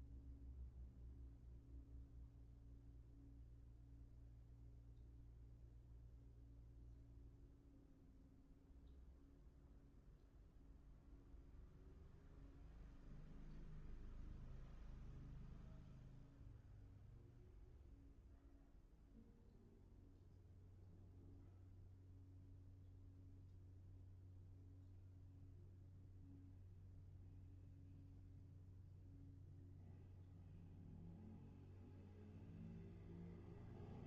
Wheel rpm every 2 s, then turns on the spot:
0, 0, 0, 0, 0, 0, 0, 0, 0, 0, 0, 0, 0, 0, 0, 0, 0.
none